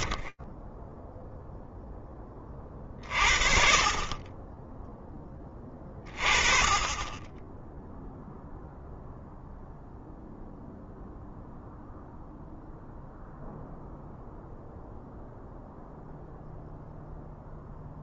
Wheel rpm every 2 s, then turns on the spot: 0, 40, 20, 20, 0, 0, 0, 0, 0.
none